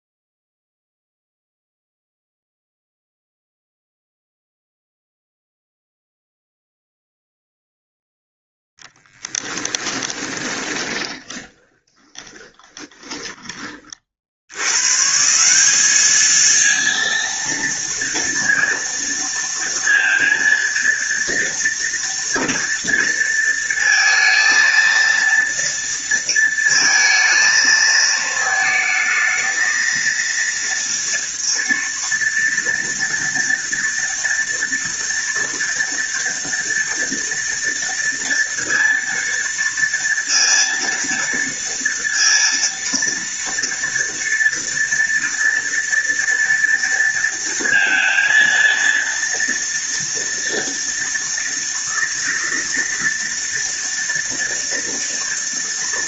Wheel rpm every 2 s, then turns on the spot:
0, 0, 0, 0, 10, 20, 10, 120, 230, 230, 230, 230, 230, 230, 220, 230, 230, 230, 230, 230, 230, 230, 230, 230, 230, 230, 230, 230.
8-14